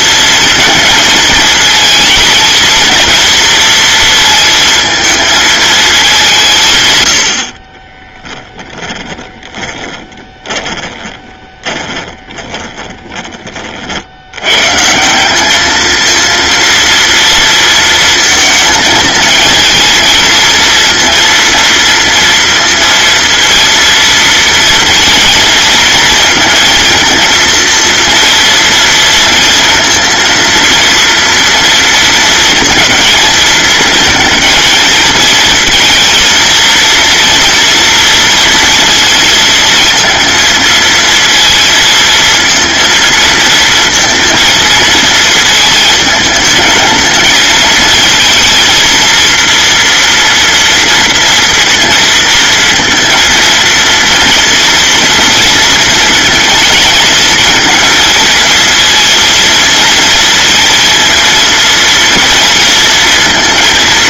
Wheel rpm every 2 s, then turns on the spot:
220, 220, 230, 140, 10, 20, 20, 130, 230, 230, 230, 230, 230, 230, 230, 230, 230, 230, 230, 230, 230, 230, 230, 220, 230, 230, 230, 230, 230, 230, 230, 230.
8-14